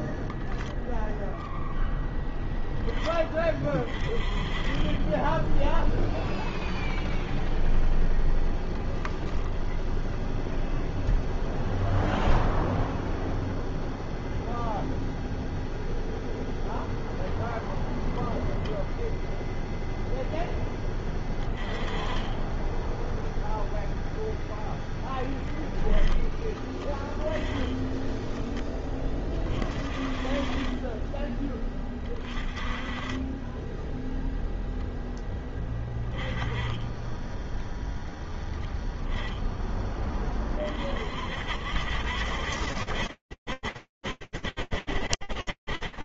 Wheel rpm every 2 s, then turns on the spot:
10, 20, 0, 0, 0, 0, 0, 0, 10, 0, 20, 0, 10, 10, 20, 20, 20, 10, 10, 10, 50, 60, 40.
none